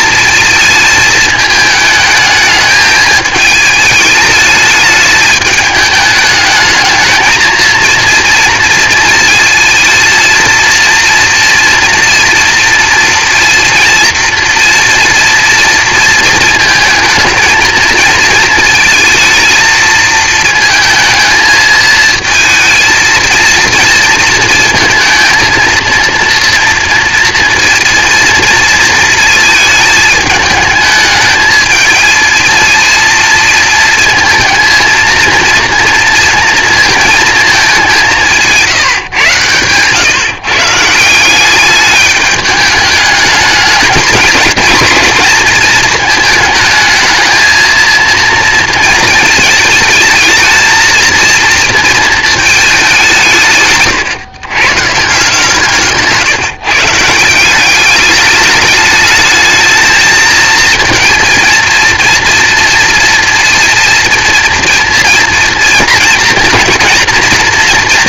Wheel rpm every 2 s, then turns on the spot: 220, 210, 210, 220, 230, 230, 230, 230, 220, 220, 220, 230, 230, 230, 230, 210, 230, 220, 230, 160, 150, 210, 220, 220, 230, 230, 210, 140, 150, 210, 220, 230, 230, 230.
none